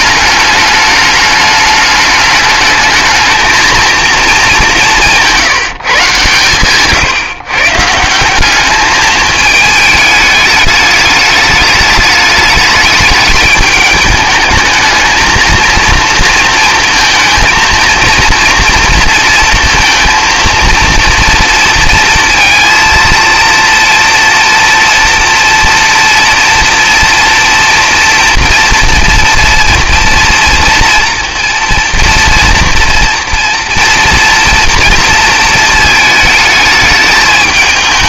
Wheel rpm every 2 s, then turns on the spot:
210, 210, 210, 130, 200, 210, 210, 220, 230, 230, 230, 230, 230, 230, 240, 230, 230, 230, 210.
none